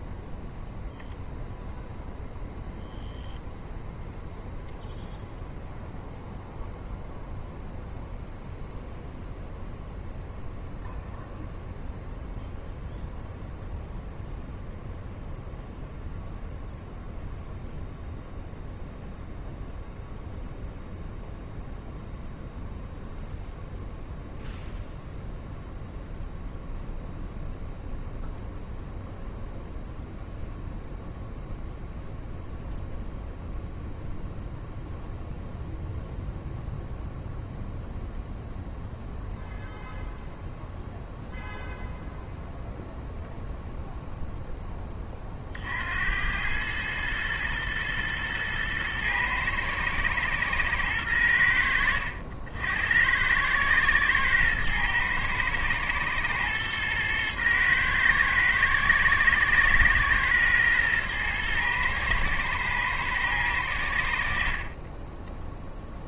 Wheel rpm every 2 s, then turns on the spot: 0, 0, 0, 0, 0, 0, 0, 0, 0, 0, 0, 0, 0, 0, 0, 0, 0, 0, 0, 0, 0, 0, 10, 110, 110, 110, 70, 110, 110, 110, 110, 110, 40.
none